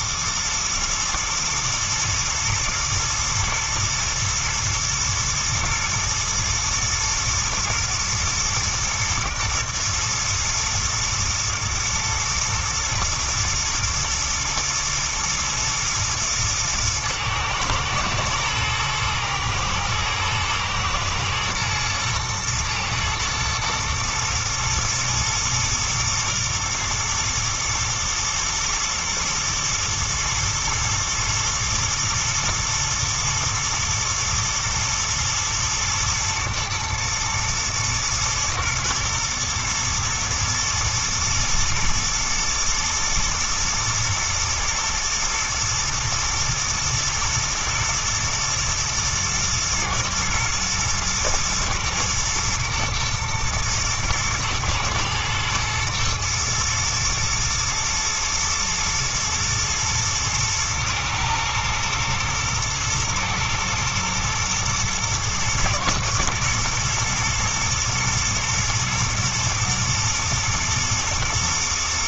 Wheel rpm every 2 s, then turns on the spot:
110, 110, 110, 120, 120, 110, 120, 120, 110, 110, 110, 110, 110, 110, 110, 110, 120, 120, 120, 120, 110, 110, 110, 110, 110, 110, 110, 110, 110, 110, 110, 110, 120, 120, 110, 110.
none